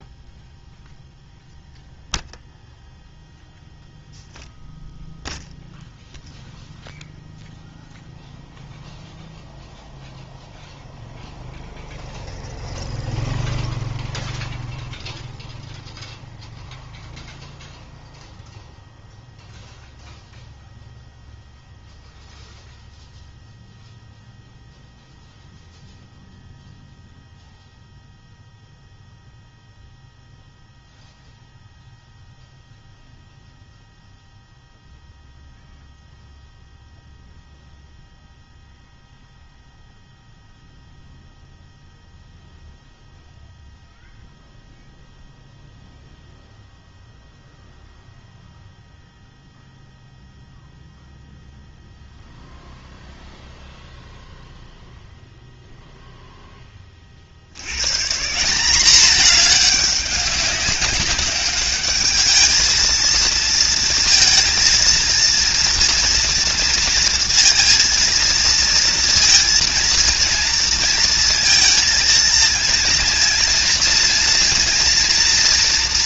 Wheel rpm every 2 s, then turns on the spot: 0, 0, 0, 0, 0, 0, 0, 0, 0, 0, 0, 0, 0, 0, 0, 0, 0, 0, 0, 0, 0, 0, 0, 0, 0, 0, 0, 0, 0, 150, 200, 210, 230, 230, 230, 230, 230, 230.
none